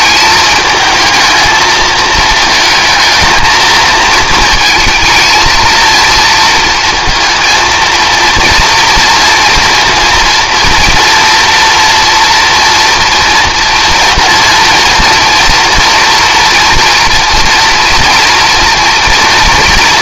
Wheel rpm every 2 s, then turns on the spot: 210, 220, 220, 230, 230, 230, 230, 230, 230, 240.
none